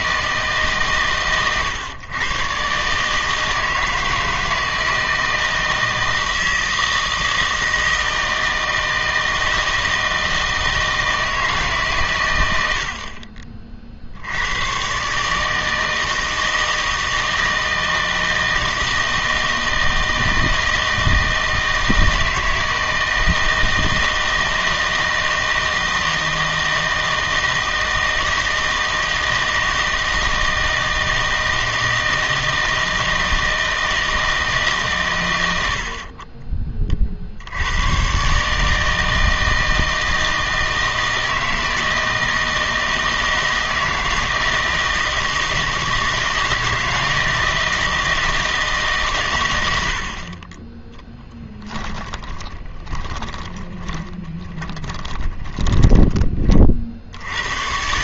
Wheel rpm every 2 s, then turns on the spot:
150, 120, 160, 160, 160, 160, 100, 100, 160, 160, 160, 160, 160, 160, 160, 160, 160, 150, 30, 150, 160, 160, 160, 160, 160, 20, 10, 20, 30.
52-56